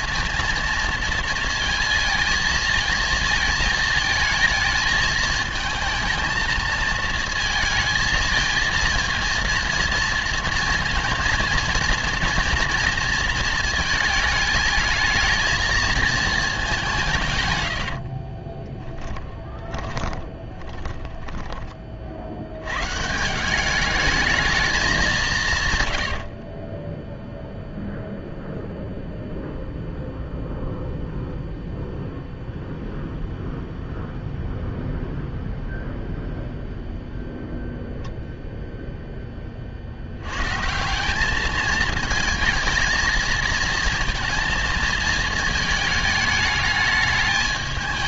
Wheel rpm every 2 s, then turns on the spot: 230, 220, 220, 220, 230, 230, 230, 220, 200, 20, 20, 100, 220, 40, 0, 0, 0, 0, 0, 0, 140, 220, 230, 210.
18-22 26-28